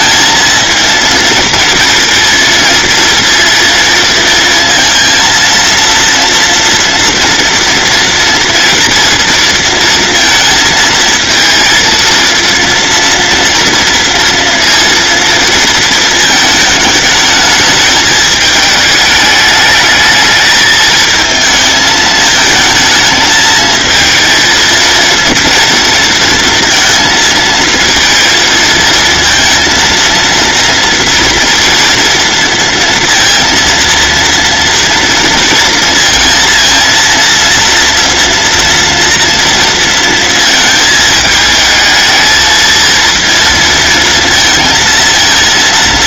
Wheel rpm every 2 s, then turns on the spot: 230, 230, 230, 240, 230, 230, 230, 230, 210, 210, 220, 220, 230, 230, 230, 230, 230, 230, 230, 230, 220, 230, 230.
none